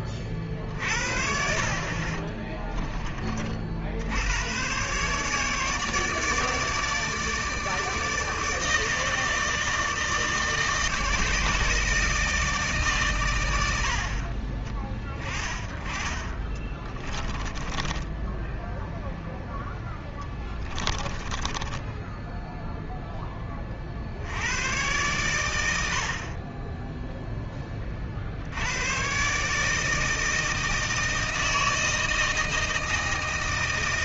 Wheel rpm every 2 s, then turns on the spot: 40, 20, 120, 150, 160, 150, 140, 30, 20, 10, 10, 0, 100, 20, 90, 160, 160.
16-18 20-22